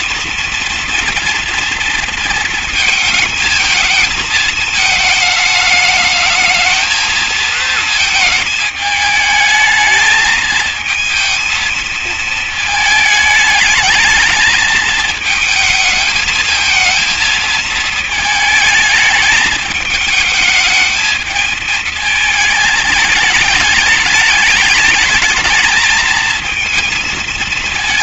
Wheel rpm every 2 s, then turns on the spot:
240, 230, 220, 220, 220, 220, 220, 220, 220, 220, 210, 210, 210, 220.
none